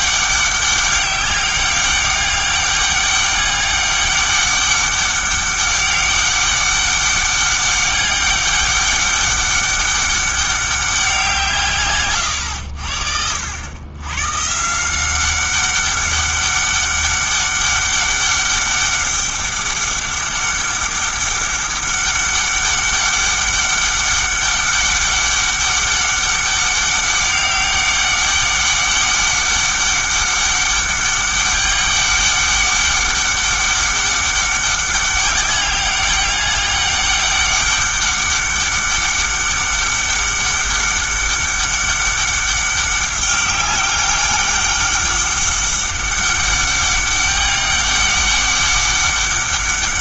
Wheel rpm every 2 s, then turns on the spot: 200, 200, 200, 200, 200, 190, 90, 150, 200, 200, 200, 200, 200, 200, 200, 200, 200, 200, 200, 200, 200, 200, 200, 200, 200.
none